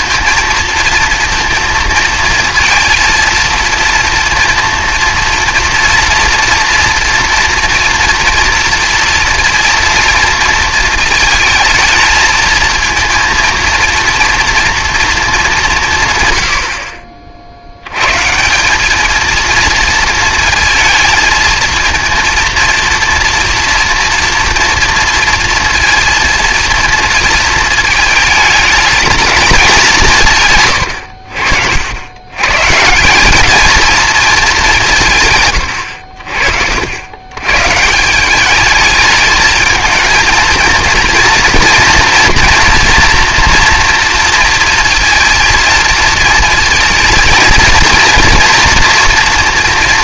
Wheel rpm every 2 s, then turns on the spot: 230, 230, 230, 230, 230, 230, 230, 230, 60, 200, 230, 230, 230, 220, 210, 110, 150, 180, 80, 210, 230, 230, 230, 220, 230.
none